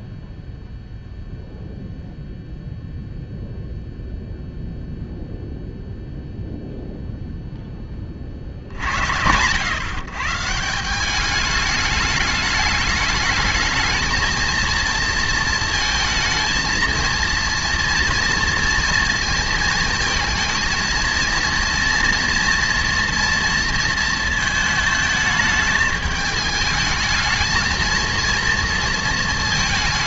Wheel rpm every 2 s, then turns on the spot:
0, 0, 0, 0, 80, 180, 210, 230, 230, 230, 230, 230, 220, 220, 230.
none